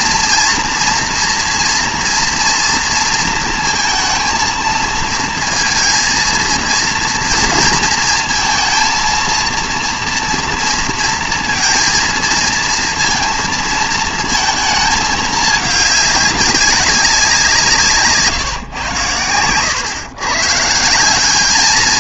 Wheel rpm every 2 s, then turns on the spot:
230, 230, 230, 230, 230, 230, 230, 220, 190, 130, 140.
none